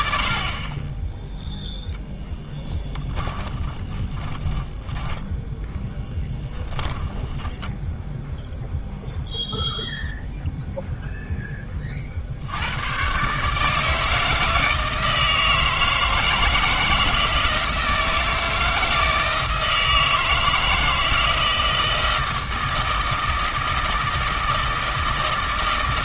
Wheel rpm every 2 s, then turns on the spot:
20, 10, 10, 10, 0, 0, 100, 160, 160, 160, 160, 160, 160.
2-8